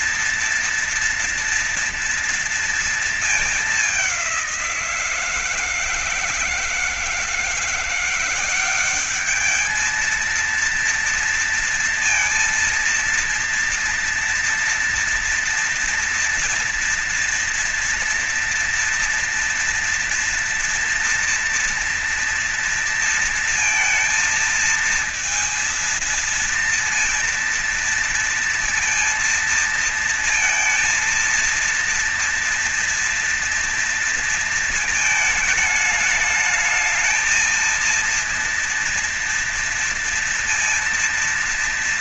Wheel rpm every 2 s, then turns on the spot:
230, 230, 170, 160, 190, 230, 230, 230, 240, 230, 230, 230, 230, 230, 230, 230, 230, 220, 220, 230, 230.
none